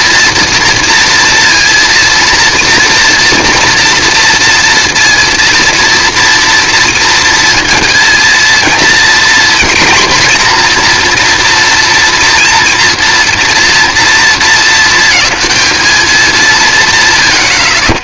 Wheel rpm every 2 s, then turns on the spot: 230, 230, 230, 230, 230, 240, 230, 230, 150.
none